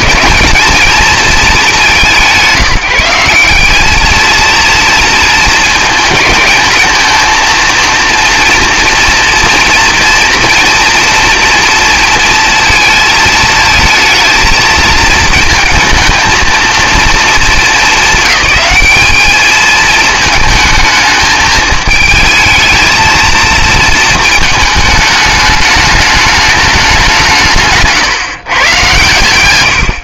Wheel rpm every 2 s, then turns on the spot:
210, 170, 220, 220, 230, 230, 220, 220, 230, 210, 220, 220, 220, 210, 130.
none